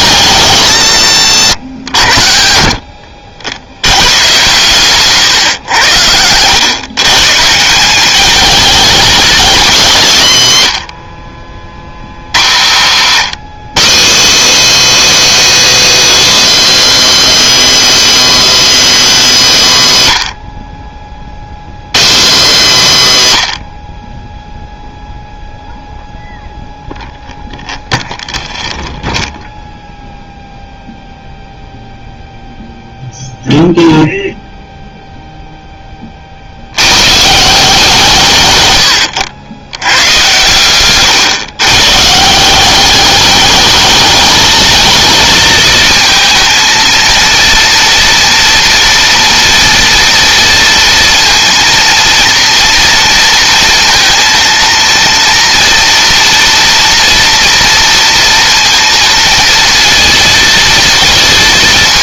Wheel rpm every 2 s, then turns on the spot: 120, 60, 130, 130, 230, 90, 120, 310, 310, 290, 60, 190, 0, 0, 0, 0, 0, 0, 110, 110, 120, 210, 220, 230, 230, 230, 230, 230, 240, 230, 230.
12-14